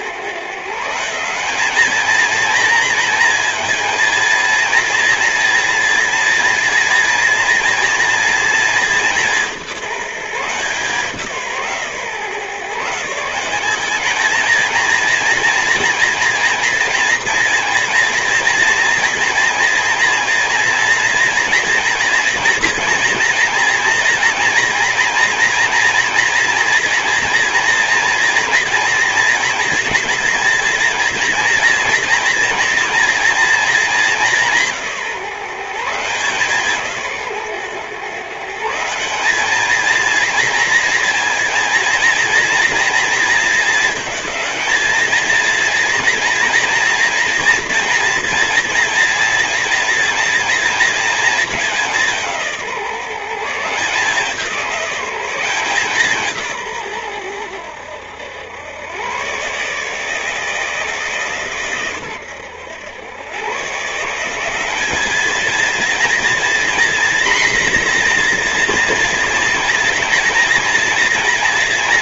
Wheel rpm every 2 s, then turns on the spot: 180, 230, 230, 230, 200, 170, 150, 220, 230, 240, 240, 230, 230, 240, 230, 230, 230, 170, 150, 160, 240, 230, 220, 230, 230, 230, 160, 190, 130, 100, 150, 100, 200, 240, 230, 240.
none